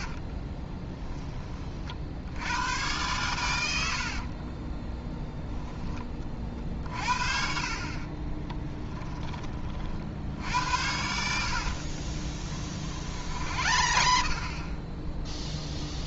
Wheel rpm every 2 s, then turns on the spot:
20, 100, 20, 50, 20, 80, 50, 30.
0-2 4-6 8-10 12-16